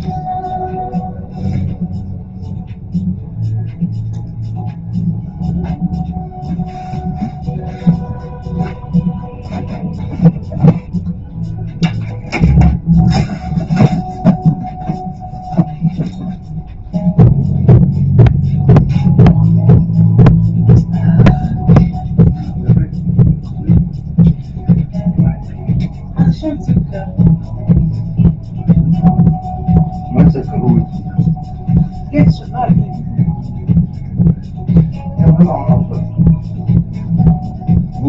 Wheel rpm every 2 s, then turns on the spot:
0, 0, 0, 0, 0, 0, 0, 0, 0, 0, 0, 0, 0, 0, 0, 0, 0, 0, 0.
none